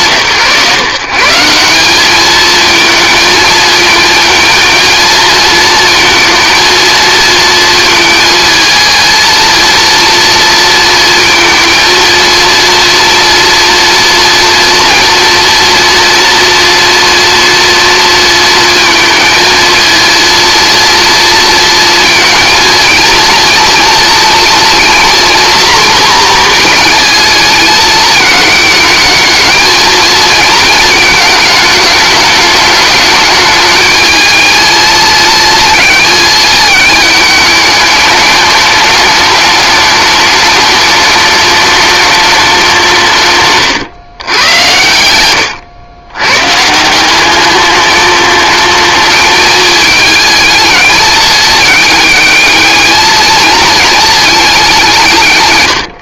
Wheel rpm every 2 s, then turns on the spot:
130, 220, 230, 230, 230, 230, 230, 230, 230, 230, 230, 230, 240, 230, 220, 230, 210, 220, 220, 210, 210, 190, 90, 140, 220, 220, 210, 200.
none